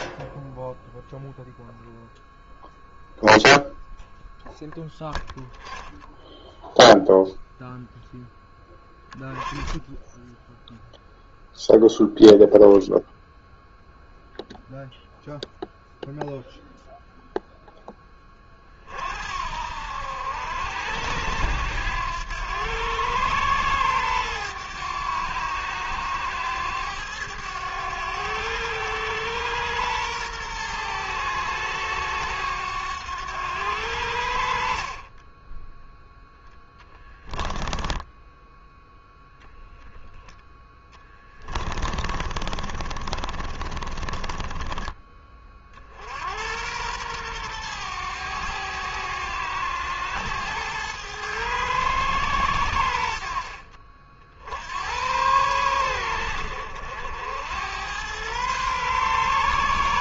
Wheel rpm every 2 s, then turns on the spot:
0, 0, 0, 0, 20, 0, 10, 0, 0, 60, 90, 110, 100, 100, 110, 110, 100, 30, 10, 0, 20, 40, 30, 110, 100, 110, 70, 100, 80, 130.
36-38 40-44